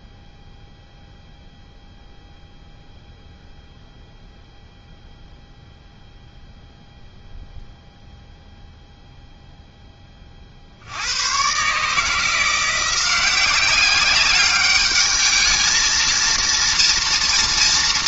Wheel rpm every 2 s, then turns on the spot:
0, 0, 0, 0, 0, 50, 180, 210, 230.
none